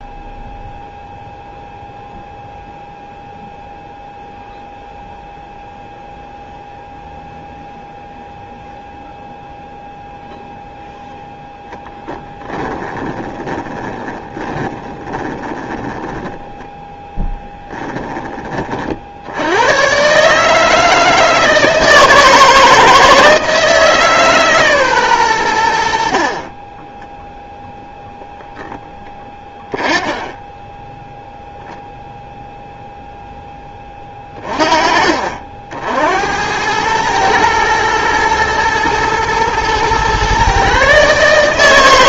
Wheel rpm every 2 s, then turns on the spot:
0, 0, 0, 0, 0, 0, 10, 20, 10, 40, 160, 160, 140, 20, 0, 10, 0, 30, 100, 110, 140.
12-18